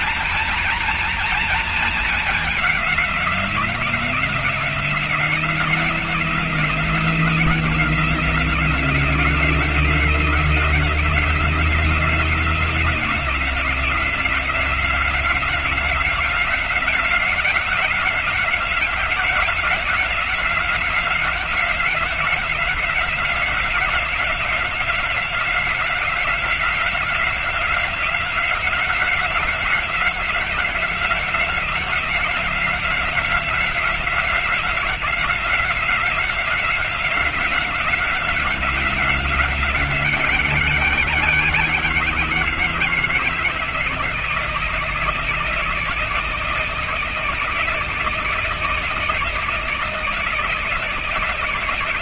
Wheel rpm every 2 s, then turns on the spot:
230, 210, 170, 170, 180, 170, 180, 180, 180, 180, 180, 180, 180, 180, 180, 180, 180, 180, 180, 180, 180, 160, 160, 160, 160, 160.
none